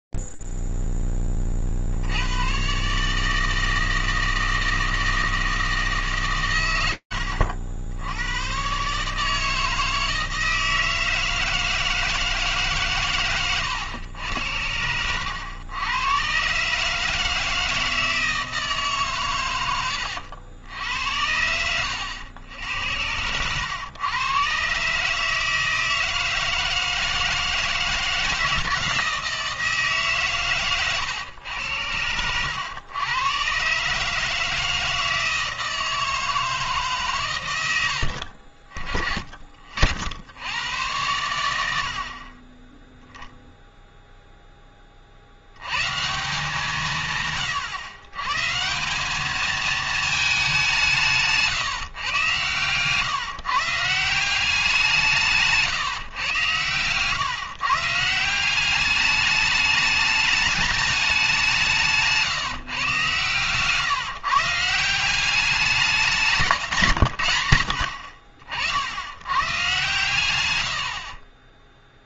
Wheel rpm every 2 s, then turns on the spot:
0, 50, 160, 160, 90, 160, 160, 110, 110, 160, 90, 100, 120, 160, 160, 140, 100, 160, 160, 50, 90, 20, 10, 160, 170, 200, 130, 190, 120, 190, 210, 150, 160, 160, 60, 90.
70-72